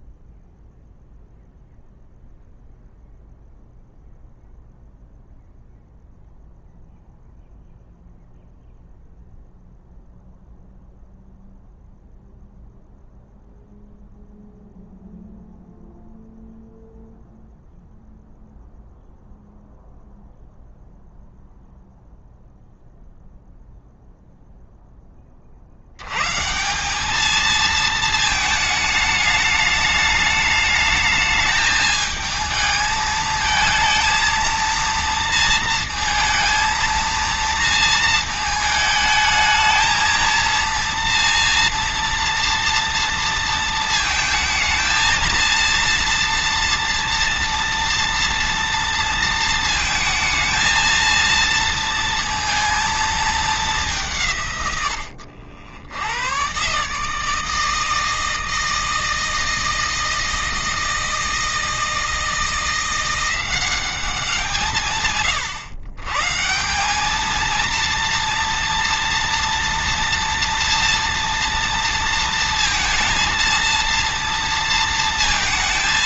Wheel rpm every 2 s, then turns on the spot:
0, 0, 0, 0, 0, 0, 0, 0, 0, 0, 0, 0, 10, 200, 220, 210, 220, 230, 230, 220, 230, 230, 220, 230, 230, 230, 220, 110, 140, 160, 160, 170, 150, 190, 230, 230, 230, 230.
none